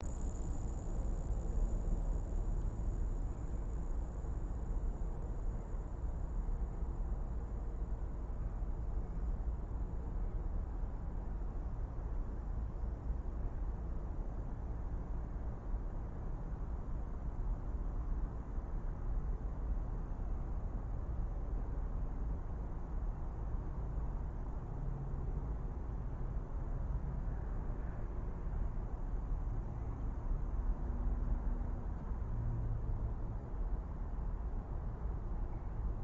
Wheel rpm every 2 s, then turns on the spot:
0, 0, 0, 0, 0, 0, 0, 0, 0, 0, 0, 0, 0, 0, 0, 0, 0, 0.
none